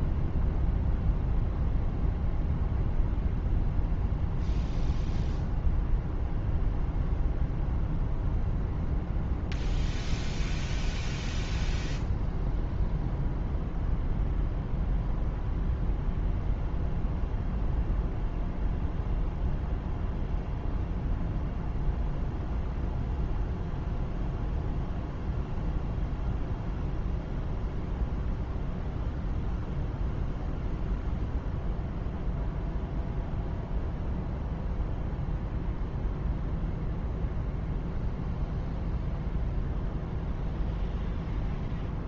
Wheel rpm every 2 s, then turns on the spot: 0, 0, 0, 0, 0, 0, 0, 0, 0, 0, 0, 0, 0, 0, 0, 0, 0, 0, 0, 0, 0.
none